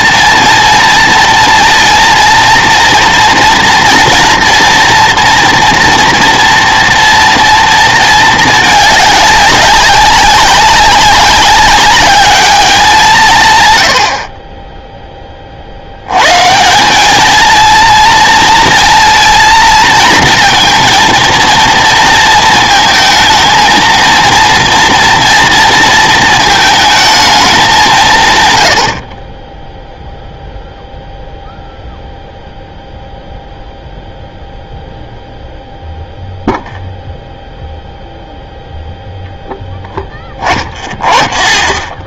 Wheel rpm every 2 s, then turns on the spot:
230, 230, 230, 230, 220, 200, 200, 20, 160, 230, 230, 230, 230, 220, 100, 0, 0, 0, 0, 0, 10.
none